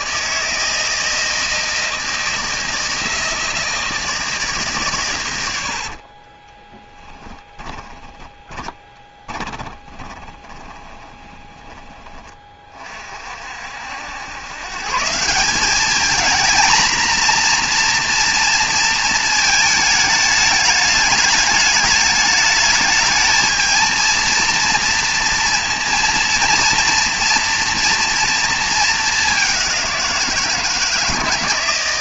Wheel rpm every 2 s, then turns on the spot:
160, 160, 150, 20, 20, 20, 30, 140, 230, 230, 220, 210, 230, 230, 220, 170.
6-12